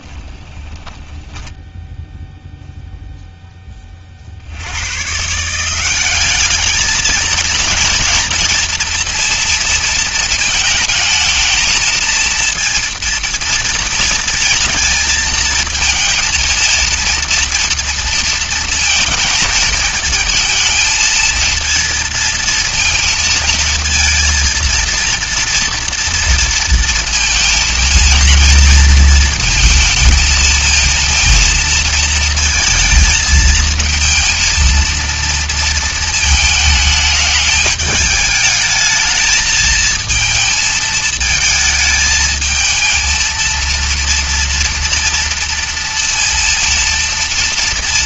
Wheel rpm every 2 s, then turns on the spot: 20, 0, 80, 210, 230, 220, 230, 230, 230, 230, 220, 230, 230, 230, 230, 230, 220, 230, 220, 220, 220, 220, 230, 230.
0-2